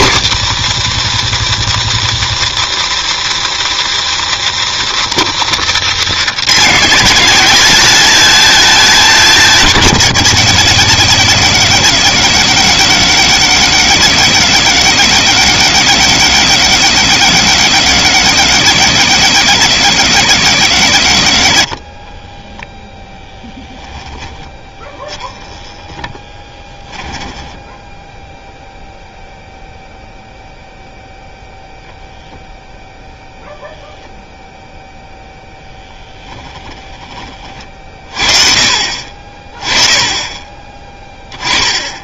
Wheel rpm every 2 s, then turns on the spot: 180, 170, 170, 160, 200, 90, 100, 90, 100, 90, 80, 10, 10, 10, 0, 0, 0, 0, 20, 40, 20.
22-28 36-38